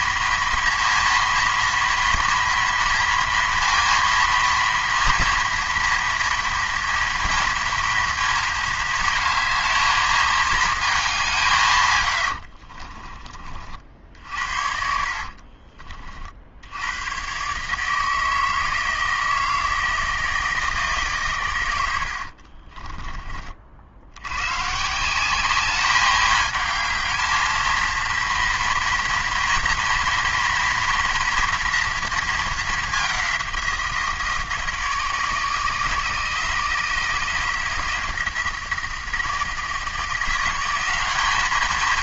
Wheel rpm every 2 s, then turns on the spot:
230, 230, 230, 230, 230, 210, 50, 50, 80, 160, 160, 40, 140, 220, 230, 240, 210, 160, 160, 160, 180.
12-16 22-24